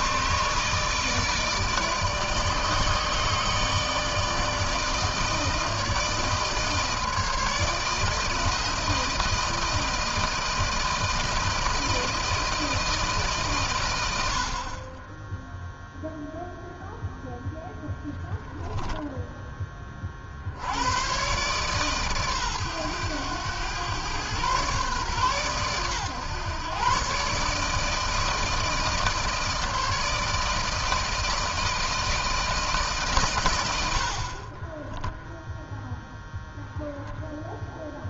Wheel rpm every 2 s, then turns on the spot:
150, 150, 160, 160, 160, 160, 160, 50, 0, 0, 80, 120, 130, 130, 160, 160, 160, 30, 0.
34-36